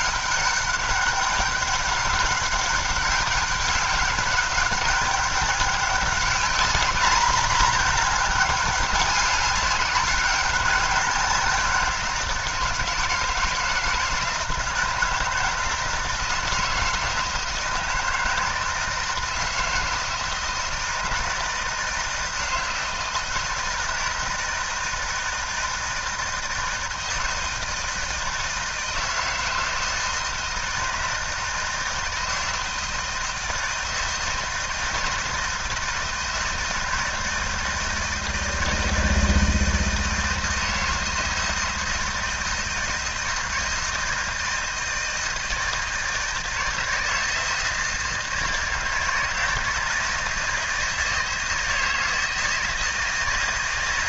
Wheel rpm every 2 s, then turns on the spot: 200, 190, 200, 210, 200, 190, 160, 160, 160, 160, 160, 160, 160, 160, 160, 160, 160, 160, 170, 160, 160, 160, 160, 160, 160, 160, 160.
none